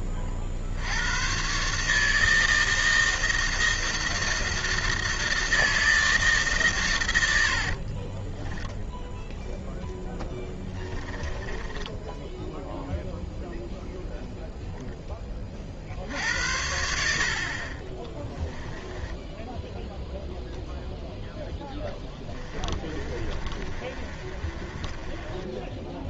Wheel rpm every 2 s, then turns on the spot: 40, 160, 160, 140, 10, 20, 0, 30, 60, 10, 0, 30, 20.
10-12 18-20 22-26